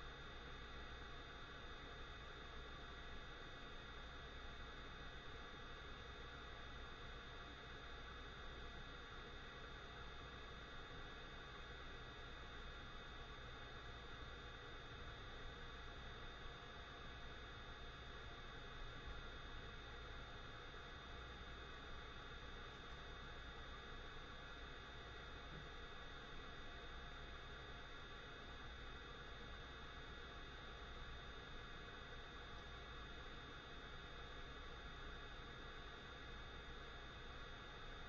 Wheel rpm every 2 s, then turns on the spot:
0, 0, 0, 0, 0, 0, 0, 0, 0, 0, 0, 0, 0, 0, 0, 0, 0, 0, 0.
none